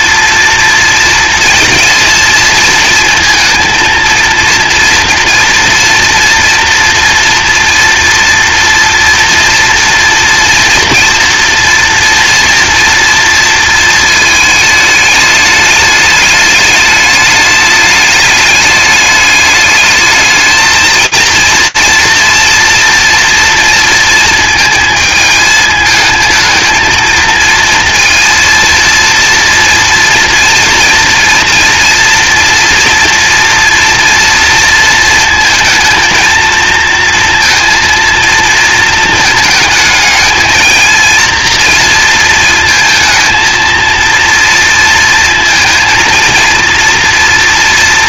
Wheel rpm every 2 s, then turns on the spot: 230, 230, 230, 230, 230, 230, 230, 220, 210, 210, 230, 230, 220, 220, 230, 230, 240, 230, 230, 220, 230, 230, 230, 230.
none